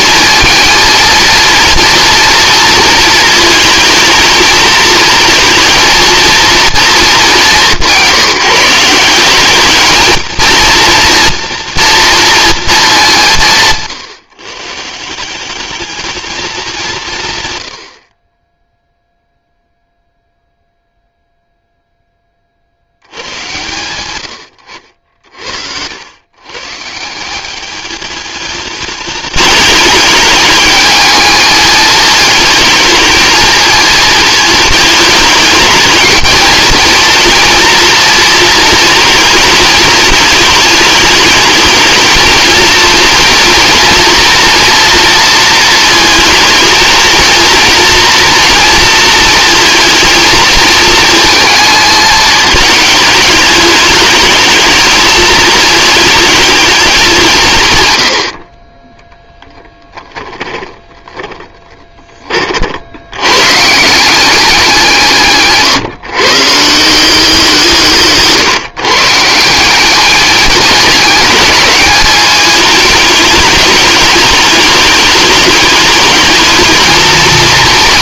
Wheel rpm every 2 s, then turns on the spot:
230, 230, 230, 220, 170, 230, 210, 160, 180, 0, 0, 80, 70, 160, 210, 210, 220, 210, 230, 220, 220, 220, 230, 220, 230, 220, 210, 220, 200, 20, 10, 80, 170, 170, 160, 210, 210, 210, 220.
60-62